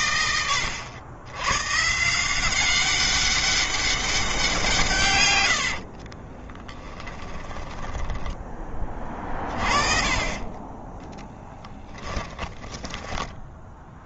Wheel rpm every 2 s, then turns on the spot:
100, 190, 140, 10, 20, 10, 20.
6-8